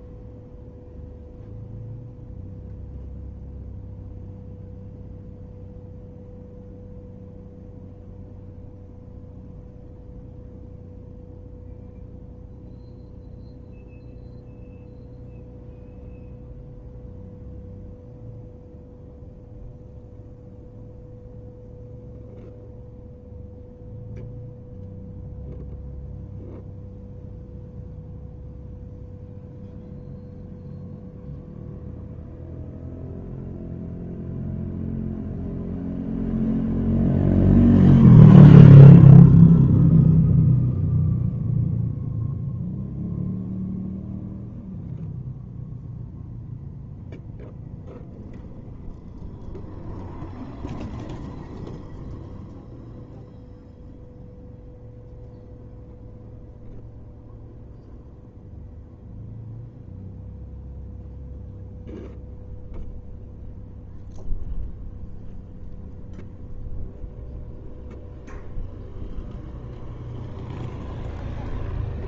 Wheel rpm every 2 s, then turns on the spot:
0, 0, 0, 0, 0, 0, 0, 0, 0, 0, 0, 0, 0, 0, 0, 0, 0, 0, 0, 0, 0, 0, 0, 0, 0, 0, 0, 0, 0, 0, 0, 0, 0, 0, 0, 0.
none